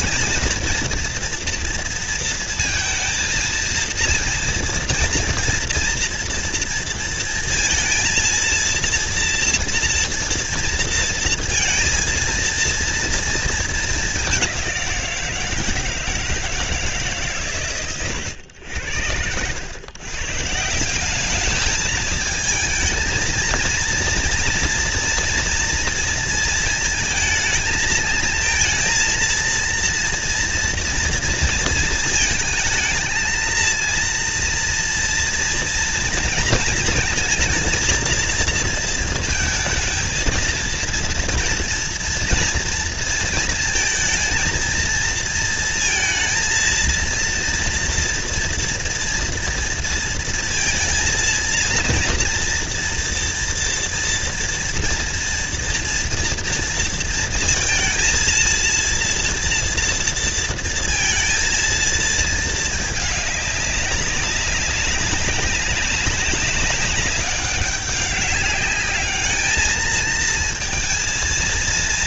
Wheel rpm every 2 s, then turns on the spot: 230, 230, 230, 230, 230, 230, 230, 190, 160, 80, 170, 220, 230, 230, 230, 230, 220, 230, 230, 230, 230, 230, 230, 230, 230, 230, 230, 230, 230, 230, 230, 220, 200, 190, 200, 230.
none